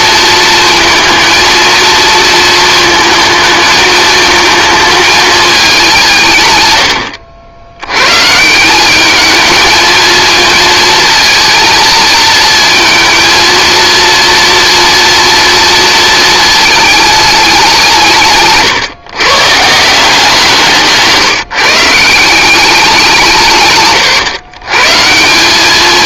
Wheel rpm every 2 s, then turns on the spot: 230, 230, 220, 120, 170, 220, 230, 240, 220, 150, 170, 190, 110.
none